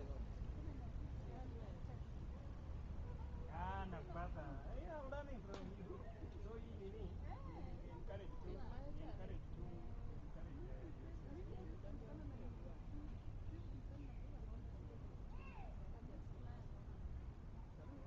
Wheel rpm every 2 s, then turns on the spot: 0, 0, 0, 0, 0, 0, 0, 0, 0.
none